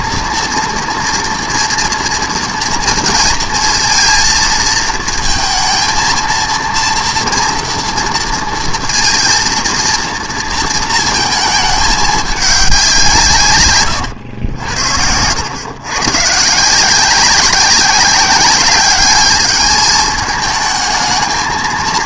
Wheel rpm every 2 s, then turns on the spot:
230, 230, 230, 230, 230, 230, 200, 90, 150, 200, 220.
none